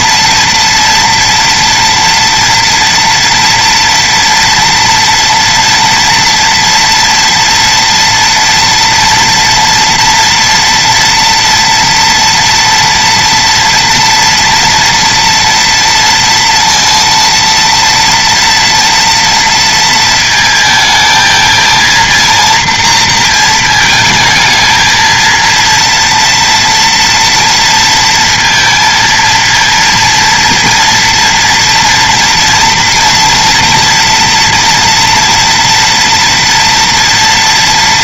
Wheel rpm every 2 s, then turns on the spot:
230, 240, 230, 240, 230, 230, 230, 230, 230, 240, 230, 230, 220, 230, 230, 230, 230, 240, 230.
none